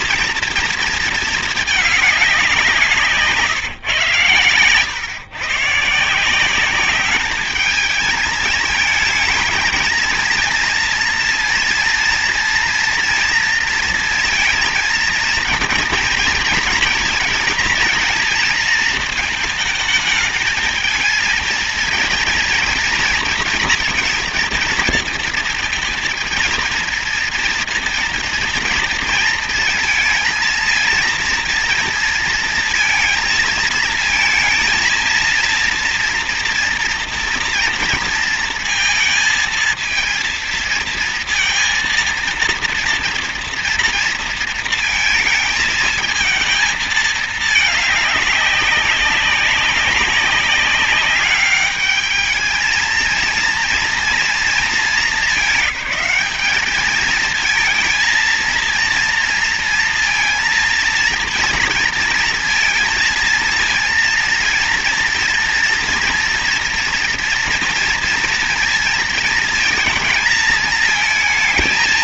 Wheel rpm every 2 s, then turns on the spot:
230, 180, 120, 190, 220, 230, 230, 230, 230, 230, 230, 230, 230, 230, 230, 230, 230, 230, 230, 230, 230, 230, 230, 220, 200, 200, 220, 220, 220, 230, 230, 230, 230, 230, 230, 220.
none